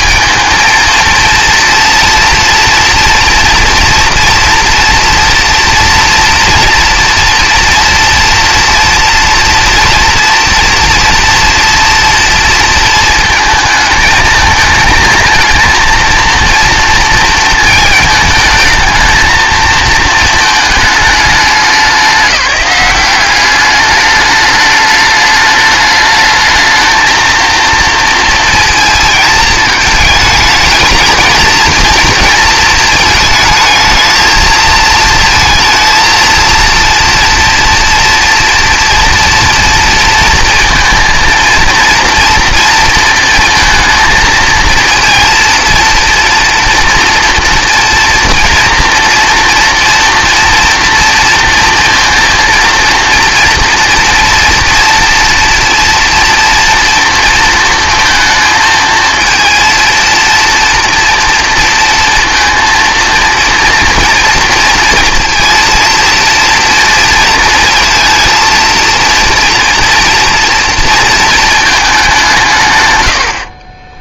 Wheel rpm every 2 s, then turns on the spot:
230, 230, 230, 230, 230, 230, 230, 220, 230, 220, 220, 200, 210, 220, 230, 220, 230, 230, 230, 230, 230, 230, 230, 240, 230, 230, 230, 230, 230, 220, 230, 230, 230, 230, 230, 230, 140.
none